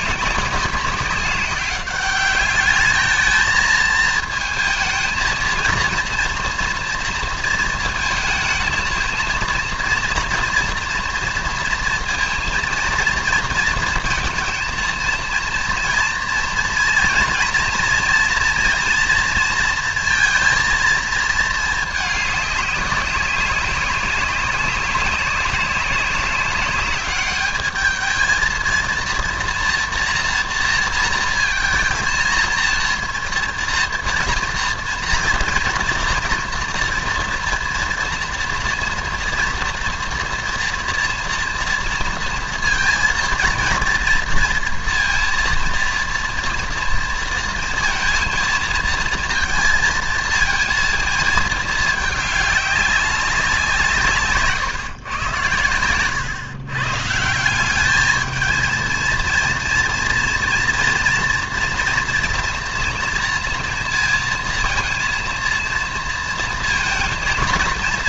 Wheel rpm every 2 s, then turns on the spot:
190, 210, 220, 230, 220, 230, 230, 230, 230, 230, 230, 210, 190, 200, 230, 240, 230, 230, 230, 240, 230, 230, 230, 230, 230, 230, 200, 140, 130, 230, 230, 230, 230, 230.
none